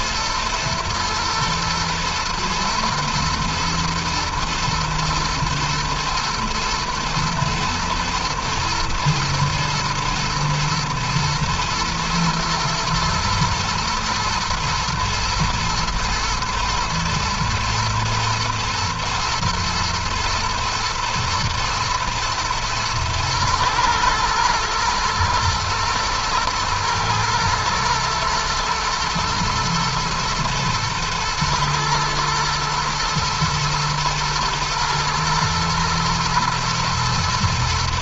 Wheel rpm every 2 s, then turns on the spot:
120, 120, 110, 110, 110, 110, 110, 110, 110, 120, 120, 110, 110, 110, 110, 110, 120, 110, 110.
none